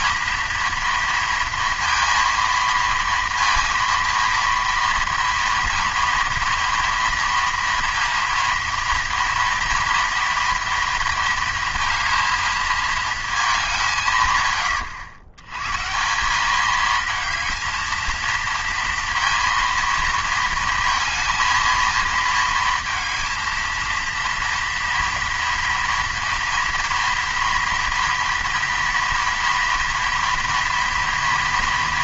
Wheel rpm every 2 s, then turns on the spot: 230, 230, 230, 230, 230, 230, 220, 110, 210, 230, 220, 230, 230, 230, 230, 230.
none